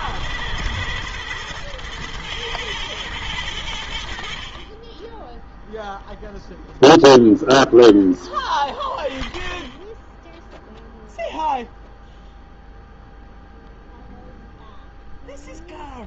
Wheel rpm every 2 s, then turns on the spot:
110, 100, 10, 0, 10, 0, 0, 0.
none